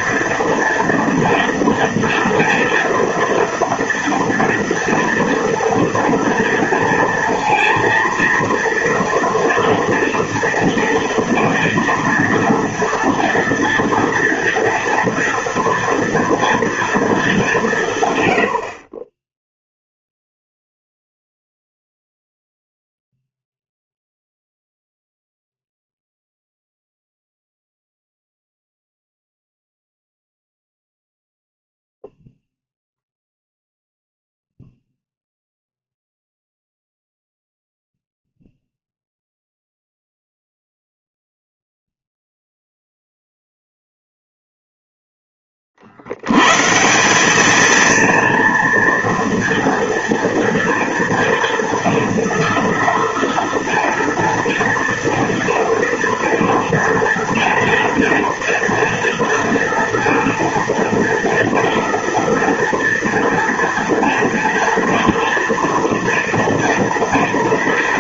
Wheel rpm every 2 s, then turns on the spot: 230, 230, 240, 230, 230, 230, 230, 230, 240, 70, 0, 0, 0, 0, 0, 0, 0, 0, 0, 0, 0, 0, 0, 140, 230, 230, 230, 230, 230, 230, 230, 230, 230, 230.
none